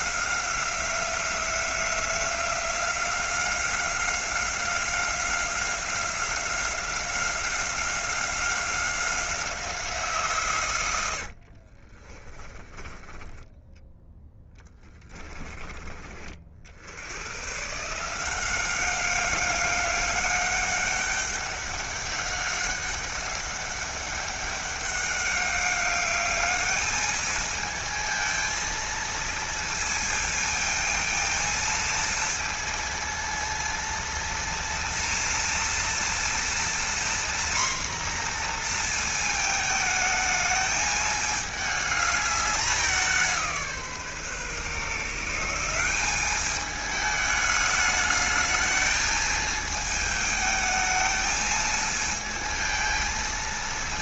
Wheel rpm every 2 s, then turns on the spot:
180, 180, 180, 180, 190, 100, 10, 30, 90, 190, 200, 200, 200, 210, 230, 230, 230, 230, 240, 230, 210, 190, 150, 210, 220, 220, 220.
10-12 14-16